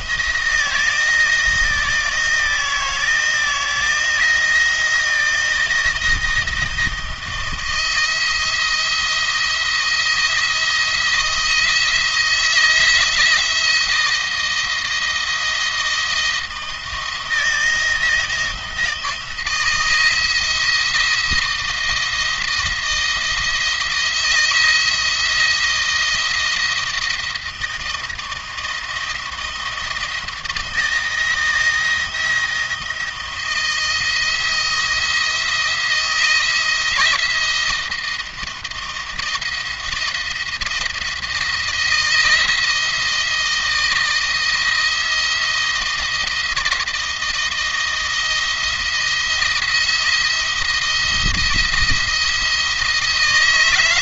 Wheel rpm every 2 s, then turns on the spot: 160, 160, 170, 160, 170, 170, 170, 160, 160, 160, 170, 170, 170, 170, 160, 160, 170, 170, 170, 170, 170, 160, 170, 170, 170, 170, 170.
none